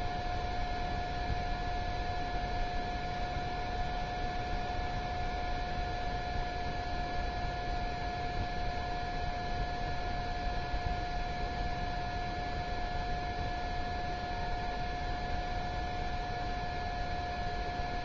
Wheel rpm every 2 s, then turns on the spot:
0, 0, 0, 0, 0, 0, 0, 0, 0.
none